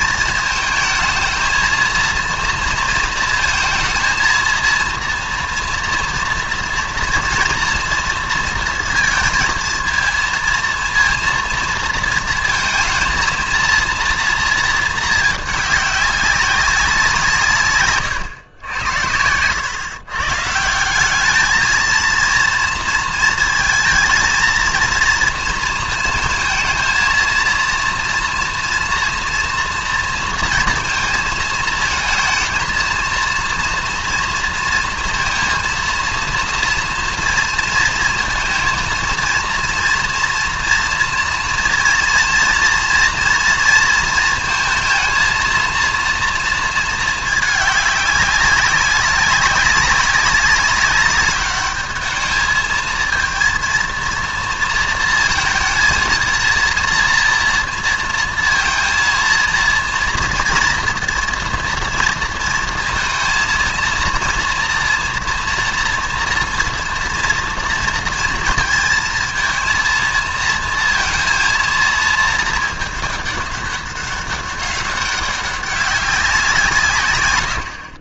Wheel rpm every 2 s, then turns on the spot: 220, 230, 230, 230, 230, 230, 230, 230, 190, 100, 170, 230, 230, 230, 230, 230, 230, 230, 230, 230, 240, 230, 220, 220, 200, 200, 220, 230, 230, 230, 230, 230, 230, 230, 230, 230, 220, 200, 160.
none